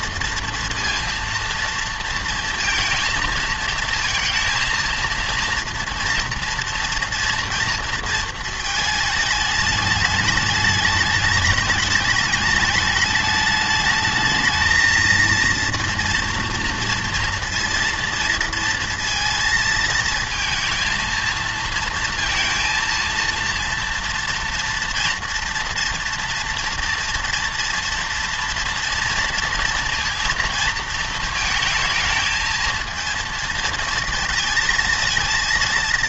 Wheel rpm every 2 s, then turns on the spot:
230, 230, 230, 230, 220, 210, 210, 220, 230, 230, 230, 230, 230, 240, 230, 230, 230, 220.
none